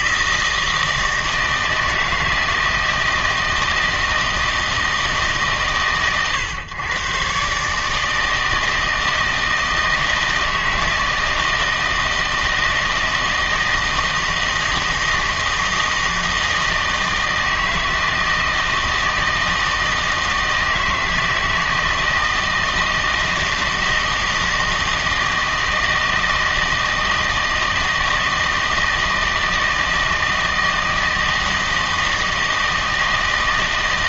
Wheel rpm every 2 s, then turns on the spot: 160, 160, 160, 120, 160, 160, 160, 160, 160, 160, 160, 160, 160, 160, 160, 160, 160.
none